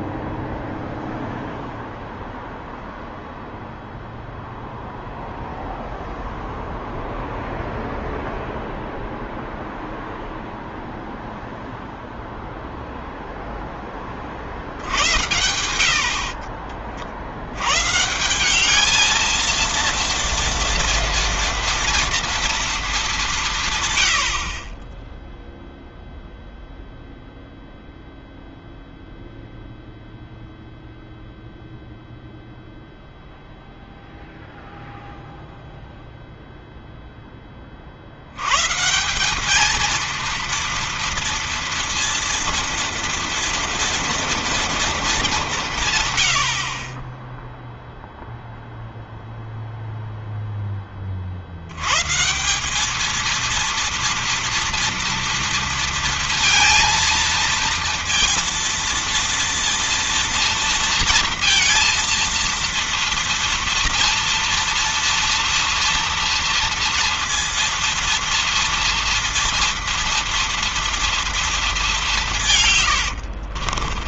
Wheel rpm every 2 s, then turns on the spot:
0, 0, 0, 0, 0, 0, 0, 60, 40, 180, 230, 230, 70, 0, 0, 0, 0, 0, 0, 130, 230, 230, 230, 70, 0, 10, 170, 230, 230, 230, 230, 230, 230, 230, 230, 230, 160.
16-18 72-74